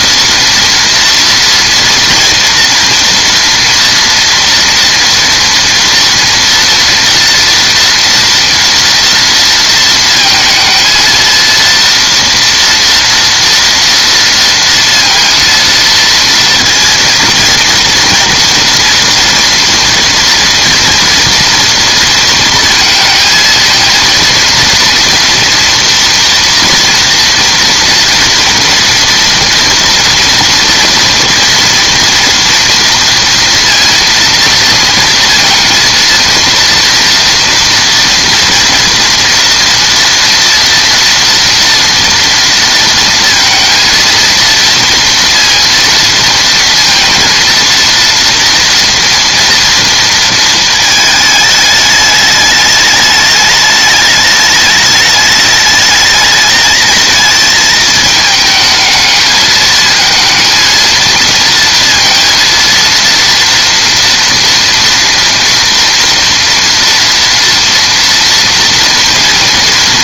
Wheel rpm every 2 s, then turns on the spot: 230, 230, 230, 230, 240, 220, 230, 230, 230, 230, 230, 220, 230, 230, 230, 240, 230, 230, 230, 230, 230, 230, 230, 230, 230, 220, 210, 210, 220, 220, 230, 230, 230, 230, 240.
none